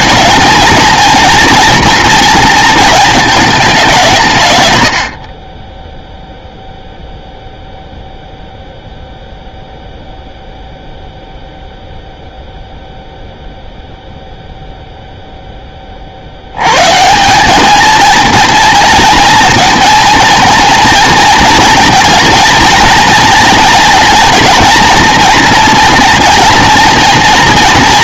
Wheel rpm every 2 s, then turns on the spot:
220, 220, 120, 0, 0, 0, 0, 0, 110, 230, 230, 230, 230, 230.
none